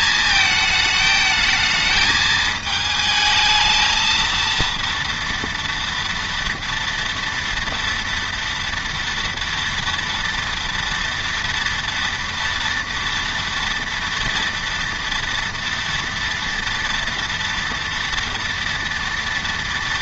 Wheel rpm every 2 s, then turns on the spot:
220, 220, 230, 240, 230, 230, 230, 230, 230, 230.
none